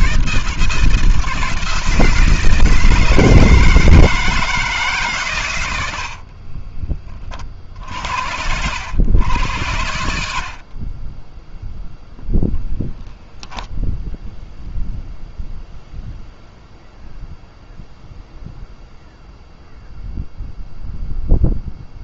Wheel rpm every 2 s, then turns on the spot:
160, 160, 140, 30, 90, 40, 0, 0, 0, 0, 0.
none